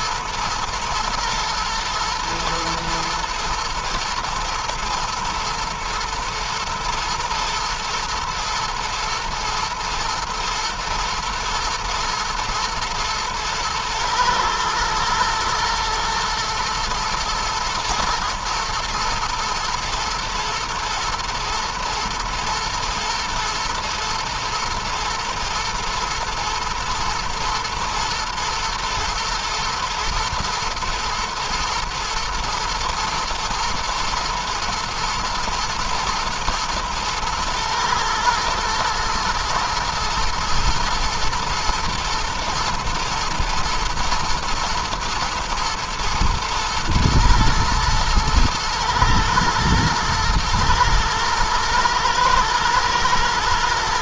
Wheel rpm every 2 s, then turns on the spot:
120, 120, 110, 110, 110, 120, 120, 110, 110, 110, 110, 120, 120, 120, 120, 110, 110, 110, 110, 110, 120, 120, 110, 110, 120, 120, 110.
none